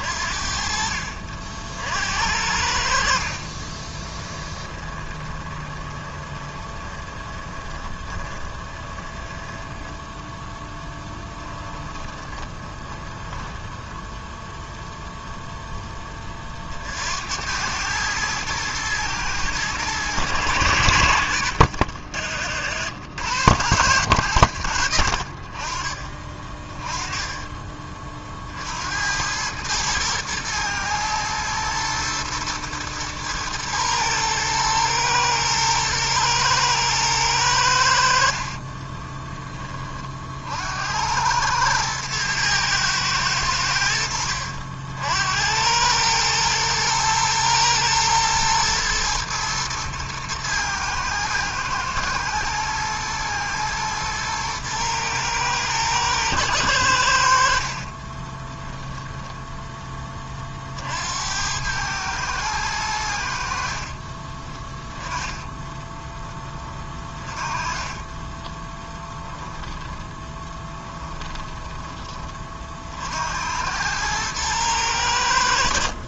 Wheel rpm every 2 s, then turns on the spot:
60, 80, 20, 20, 20, 10, 20, 0, 30, 110, 100, 80, 100, 30, 50, 110, 120, 110, 110, 40, 60, 110, 60, 110, 110, 110, 110, 120, 110, 20, 30, 110, 20, 20, 30, 20, 30, 110.
4-10 12-14 22-24 26-28 38-40 58-60 64-66 68-72